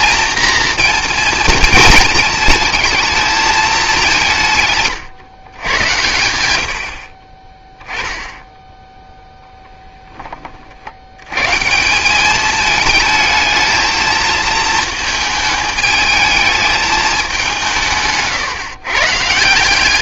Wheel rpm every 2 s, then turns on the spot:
240, 220, 140, 80, 10, 60, 220, 220, 220, 130.
none